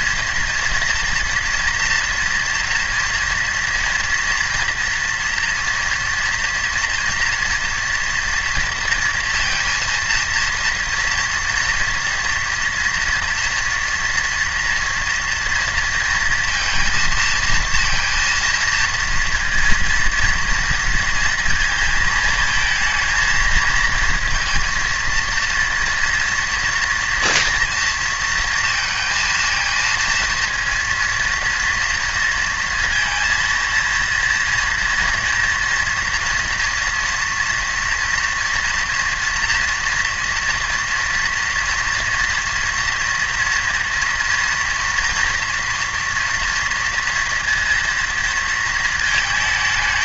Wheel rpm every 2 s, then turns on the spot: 230, 230, 230, 230, 230, 230, 230, 230, 230, 230, 240, 220, 230, 230, 230, 230, 230, 230, 230, 230, 230, 240, 230, 230, 230.
none